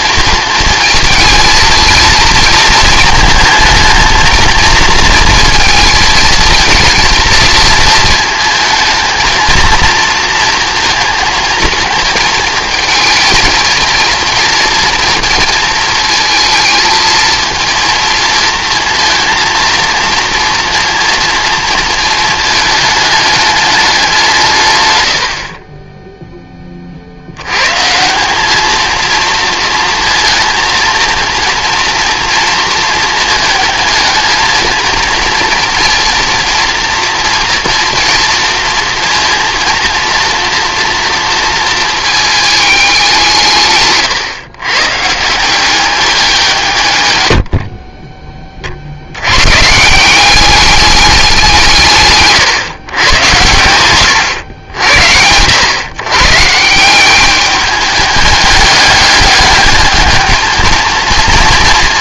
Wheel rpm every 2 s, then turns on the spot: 230, 220, 230, 230, 220, 230, 220, 230, 220, 230, 230, 210, 110, 50, 230, 230, 230, 230, 230, 230, 230, 200, 140, 130, 70, 200, 120, 90, 180, 200, 230.
none